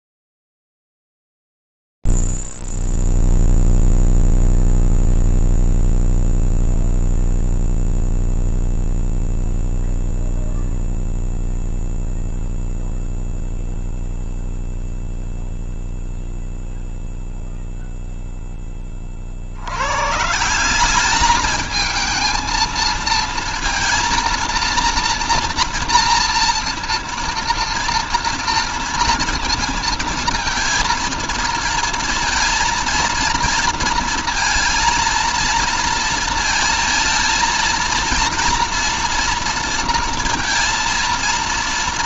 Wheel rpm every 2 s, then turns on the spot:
0, 0, 0, 0, 0, 0, 0, 0, 0, 0, 120, 220, 230, 230, 230, 230, 230, 230, 230, 230, 230.
none